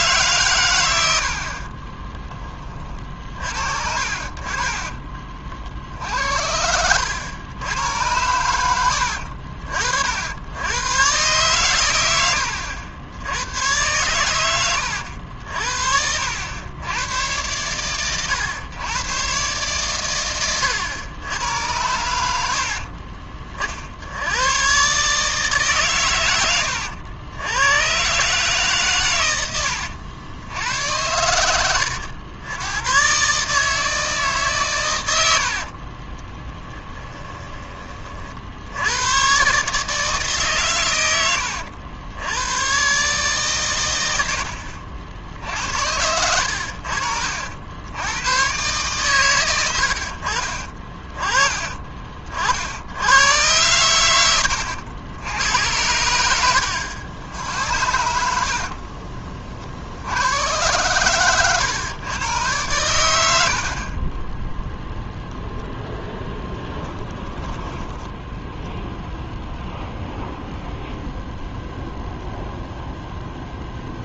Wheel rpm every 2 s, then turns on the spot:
90, 30, 30, 90, 80, 110, 80, 90, 110, 110, 110, 50, 130, 90, 130, 90, 120, 120, 20, 90, 110, 130, 60, 60, 130, 30, 90, 80, 90, 40, 110, 100, 0, 10, 0, 0, 0.
4-6 22-24 36-38 46-48 58-60 66-68